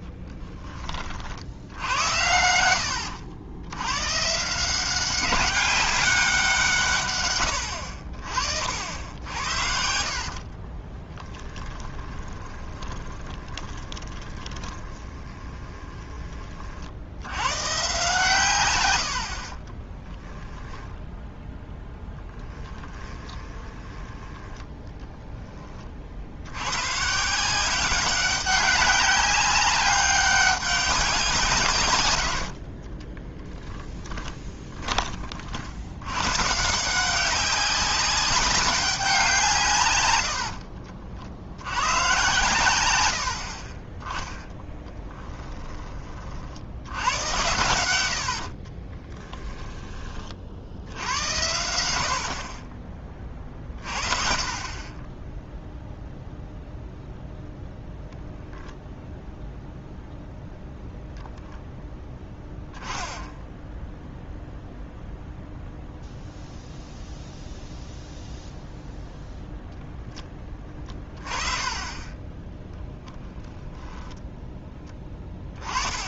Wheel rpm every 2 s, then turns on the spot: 30, 80, 180, 160, 70, 30, 20, 20, 50, 100, 10, 10, 10, 120, 190, 200, 40, 20, 160, 200, 60, 100, 10, 80, 30, 80, 20, 40, 0, 0, 0, 10, 0, 0, 0, 20, 0, 10.
8-16 20-24 32-34 40-42 44-46 48-50